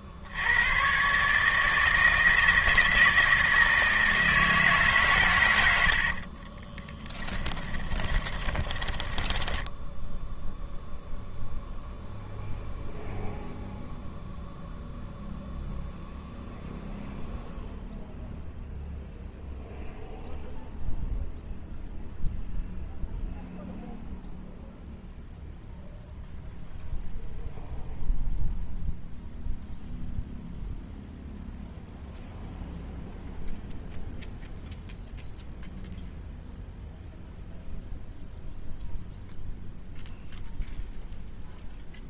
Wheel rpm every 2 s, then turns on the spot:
90, 160, 150, 20, 20, 0, 0, 0, 0, 0, 0, 0, 0, 0, 0, 0, 0, 0, 0, 0, 0.
6-10